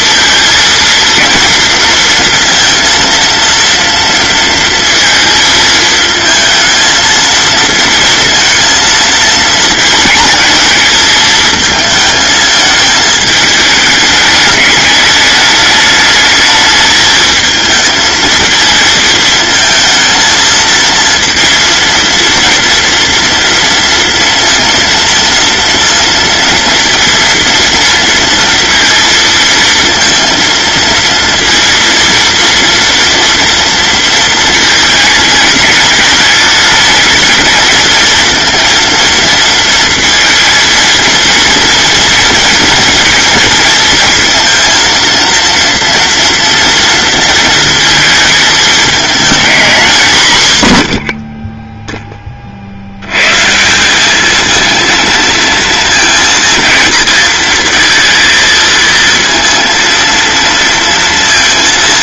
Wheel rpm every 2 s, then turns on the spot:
230, 230, 230, 230, 230, 220, 220, 210, 210, 220, 230, 230, 230, 230, 230, 230, 230, 220, 220, 230, 230, 230, 230, 230, 220, 90, 80, 220, 220, 230, 230.
none